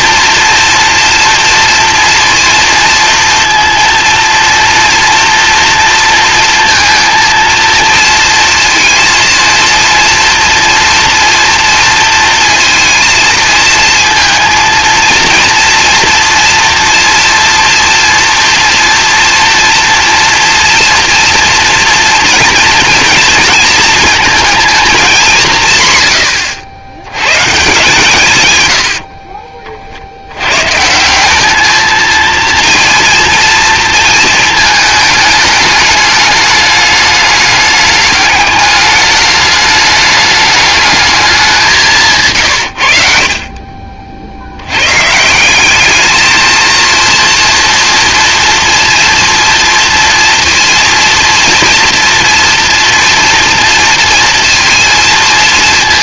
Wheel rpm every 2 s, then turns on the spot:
230, 230, 230, 230, 230, 230, 230, 230, 230, 230, 230, 230, 220, 90, 110, 120, 230, 220, 210, 210, 210, 120, 100, 230, 230, 230, 230, 230.
none